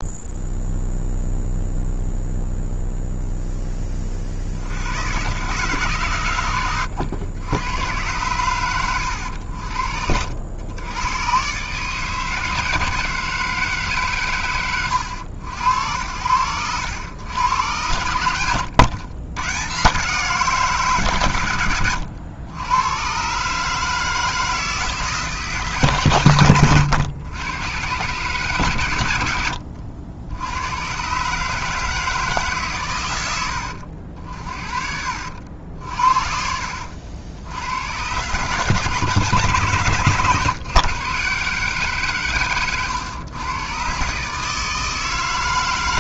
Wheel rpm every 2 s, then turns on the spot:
0, 0, 80, 110, 110, 80, 150, 140, 80, 100, 160, 100, 160, 90, 120, 100, 130, 50, 70, 140, 130, 120, 160.
18-20 26-28 42-44